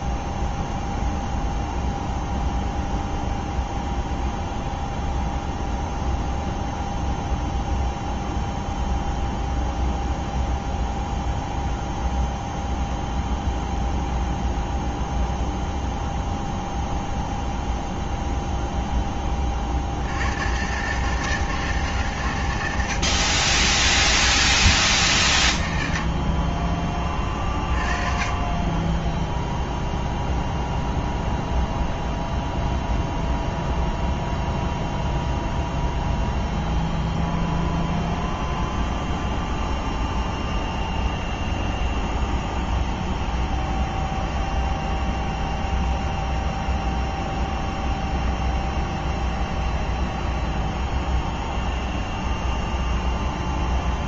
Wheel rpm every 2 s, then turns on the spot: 0, 0, 0, 0, 0, 0, 0, 0, 0, 10, 140, 100, 140, 20, 20, 0, 0, 0, 0, 0, 0, 0, 0, 0, 0, 0, 0.
none